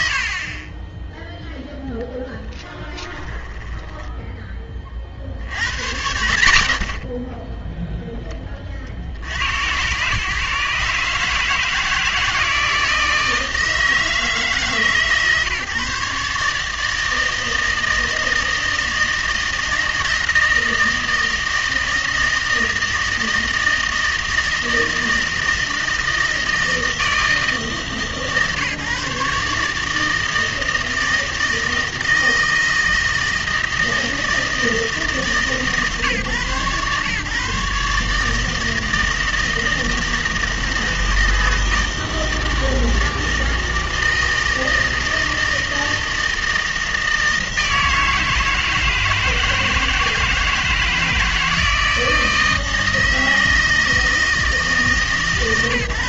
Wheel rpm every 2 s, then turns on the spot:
30, 10, 20, 70, 40, 140, 160, 150, 150, 160, 160, 160, 160, 160, 150, 160, 160, 160, 130, 160, 160, 160, 160, 160, 160, 160, 160, 150.
2-4